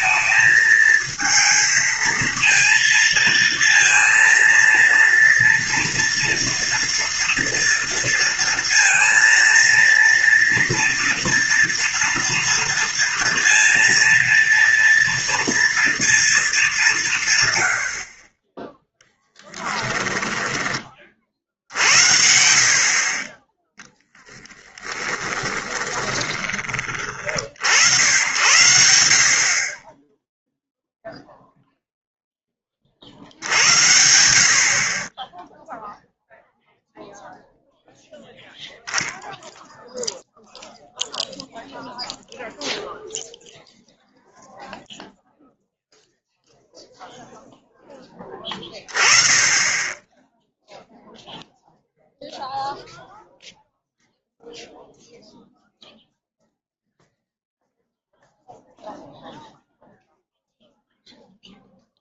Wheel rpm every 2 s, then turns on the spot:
220, 230, 230, 230, 230, 230, 230, 230, 220, 20, 10, 60, 30, 30, 100, 10, 40, 40, 0, 0, 0, 0, 0, 0, 20, 0, 0, 0, 0, 0, 0.
24-26